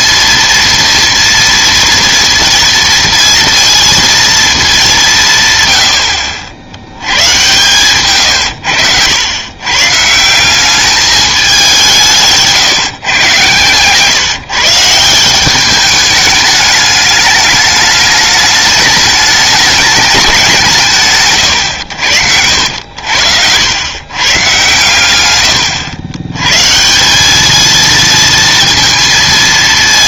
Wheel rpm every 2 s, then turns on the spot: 230, 230, 200, 70, 100, 200, 160, 150, 210, 210, 170, 90, 130, 150, 230.
none